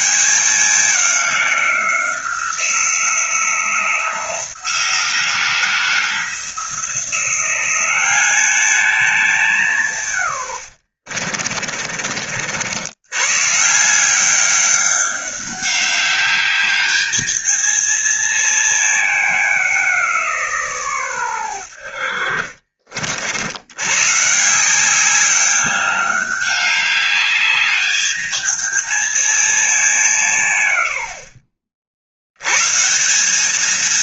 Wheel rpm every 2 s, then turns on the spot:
190, 180, 170, 170, 210, 100, 70, 200, 200, 220, 150, 50, 170, 200, 220, 130, 120.
10-12 22-24